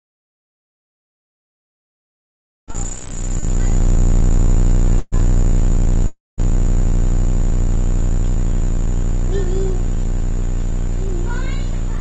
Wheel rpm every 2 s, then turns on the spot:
0, 0, 0, 0, 0, 0.
none